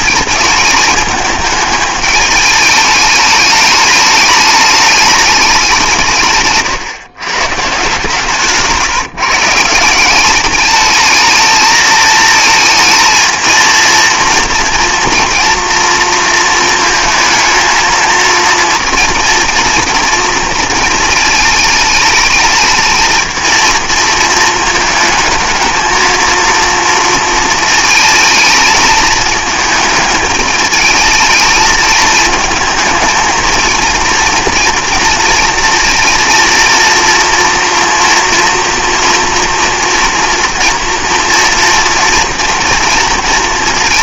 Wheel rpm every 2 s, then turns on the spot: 220, 210, 210, 140, 150, 210, 220, 230, 230, 230, 230, 220, 220, 230, 220, 220, 220, 230, 230, 230, 230, 230.
none